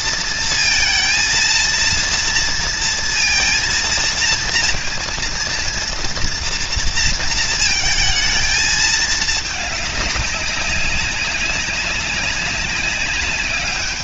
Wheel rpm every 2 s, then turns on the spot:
230, 230, 230, 230, 220, 190, 200.
none